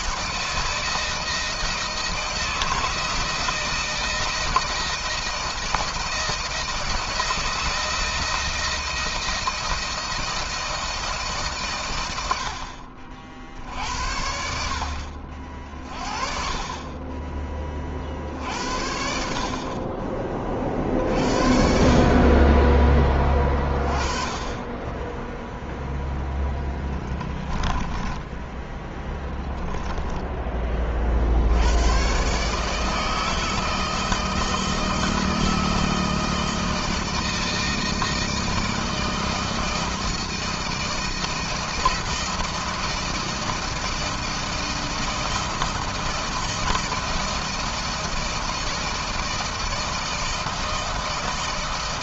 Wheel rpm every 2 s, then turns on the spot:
160, 160, 160, 160, 160, 160, 80, 70, 40, 50, 30, 30, 20, 0, 10, 10, 130, 160, 160, 160, 160, 170, 160, 170, 160, 160.
28-30